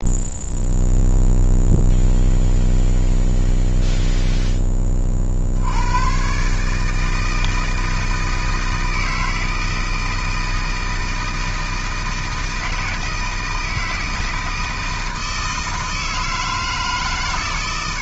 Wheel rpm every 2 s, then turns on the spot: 0, 0, 20, 150, 160, 160, 160, 160, 150.
none